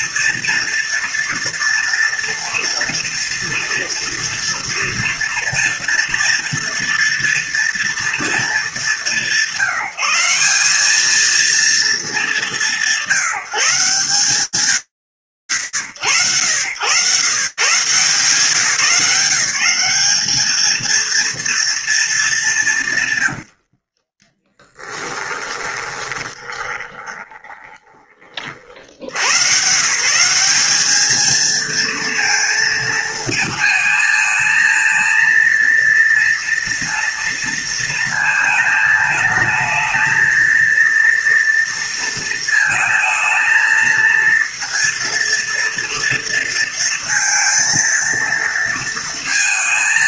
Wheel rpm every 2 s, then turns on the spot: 230, 230, 230, 230, 210, 200, 180, 160, 110, 180, 230, 120, 20, 20, 110, 220, 220, 230, 230, 220, 230, 230, 230, 230, 220.
22-28